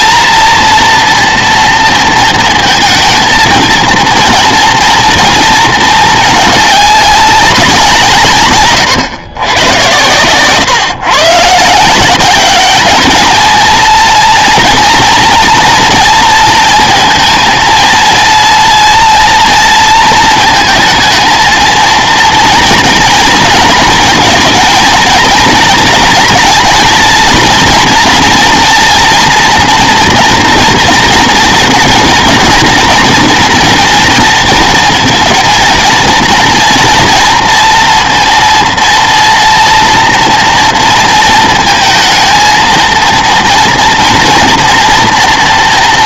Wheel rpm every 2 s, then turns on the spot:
230, 230, 230, 200, 120, 130, 210, 230, 230, 230, 220, 230, 230, 230, 240, 230, 230, 230, 230, 230, 230, 230, 230.
none